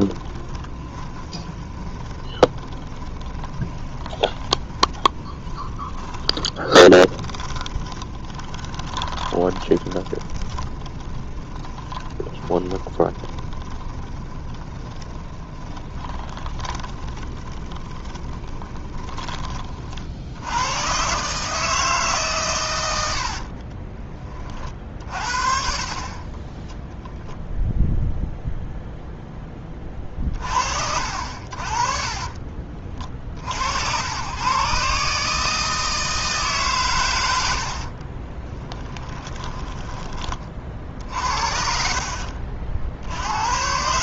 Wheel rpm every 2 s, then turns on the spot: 20, 20, 10, 20, 20, 10, 20, 20, 20, 20, 110, 110, 40, 0, 0, 50, 40, 140, 120, 20, 50, 60.
0-20 38-40